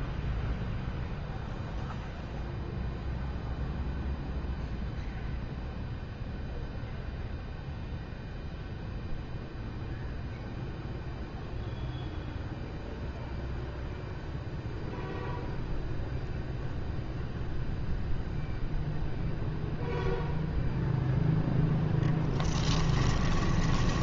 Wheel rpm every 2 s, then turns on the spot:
0, 0, 0, 0, 0, 0, 0, 0, 0, 0, 0, 10.
22-24